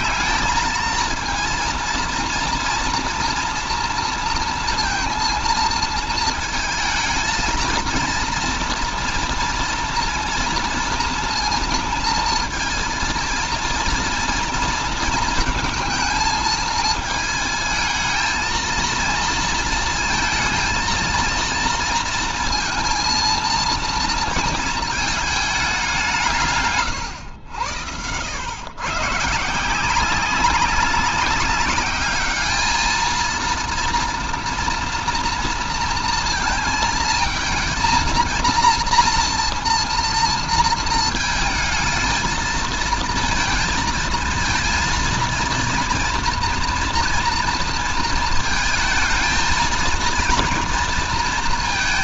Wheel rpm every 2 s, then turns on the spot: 220, 230, 230, 220, 240, 230, 230, 230, 220, 220, 230, 230, 220, 130, 130, 200, 220, 230, 220, 230, 230, 230, 230, 240, 220, 230.
none